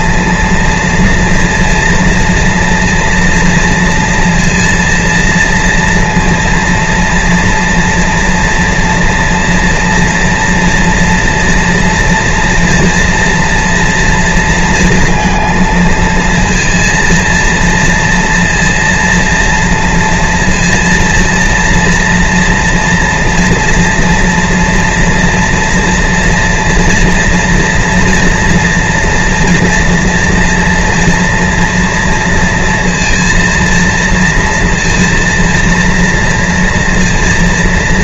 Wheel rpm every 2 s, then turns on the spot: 230, 230, 230, 230, 230, 230, 230, 230, 230, 230, 230, 230, 230, 230, 230, 230, 230, 230, 230.
none